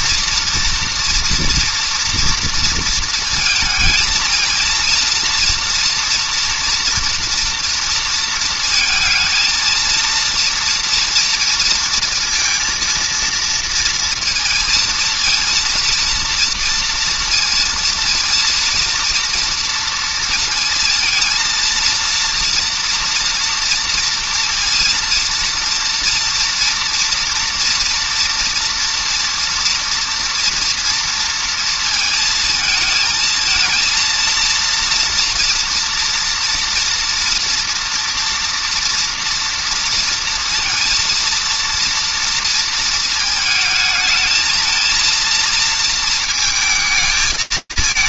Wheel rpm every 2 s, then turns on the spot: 240, 230, 230, 230, 230, 230, 230, 230, 230, 230, 230, 240, 230, 230, 230, 230, 220, 230, 230, 230, 230, 220, 220, 220.
none